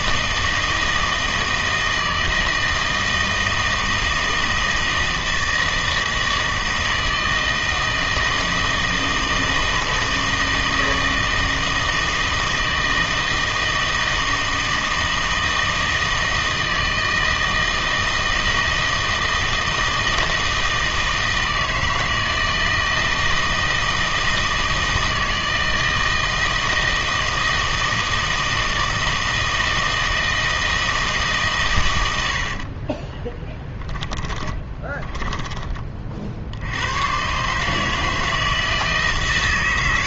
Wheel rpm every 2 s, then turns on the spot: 160, 160, 160, 160, 160, 160, 160, 160, 160, 160, 160, 160, 160, 160, 160, 160, 50, 30, 80, 160.
32-36